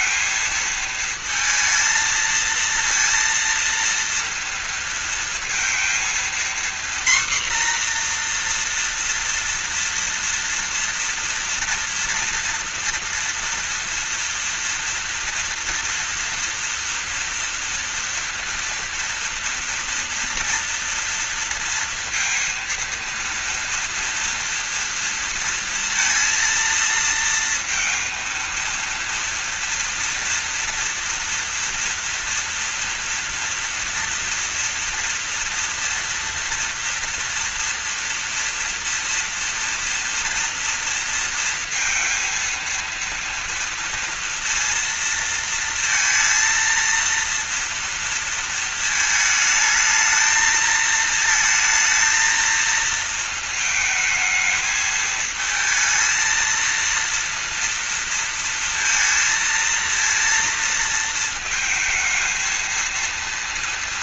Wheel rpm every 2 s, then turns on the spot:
220, 230, 230, 240, 240, 230, 230, 230, 230, 240, 230, 230, 230, 230, 230, 230, 230, 230, 230, 230, 240, 230, 230, 230, 230, 220, 230, 220, 230, 230, 230, 220.
none